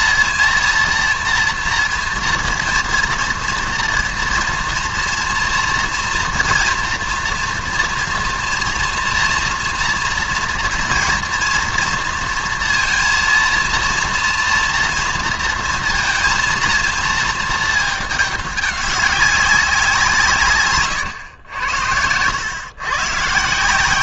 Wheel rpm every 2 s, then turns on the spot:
230, 230, 230, 230, 230, 230, 230, 230, 230, 210, 140, 100.
none